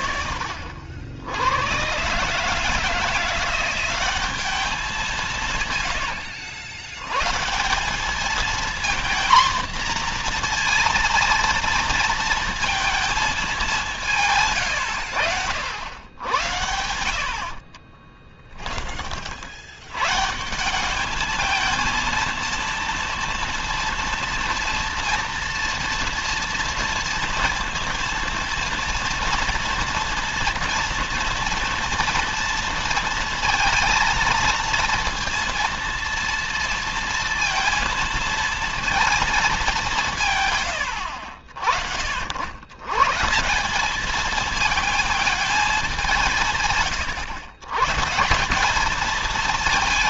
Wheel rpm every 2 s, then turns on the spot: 70, 160, 180, 100, 240, 230, 230, 120, 70, 40, 190, 230, 230, 230, 230, 230, 230, 230, 230, 230, 100, 130, 220, 130, 220.
none